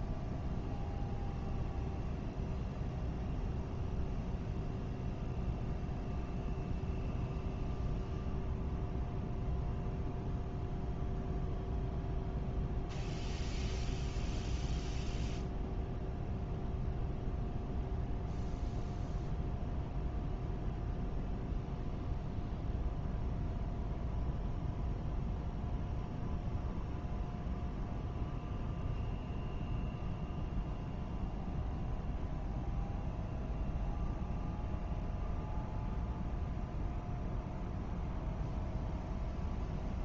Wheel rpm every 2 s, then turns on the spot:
0, 0, 0, 0, 0, 0, 0, 0, 0, 0, 0, 0, 0, 0, 0, 0, 0, 0, 0, 0.
none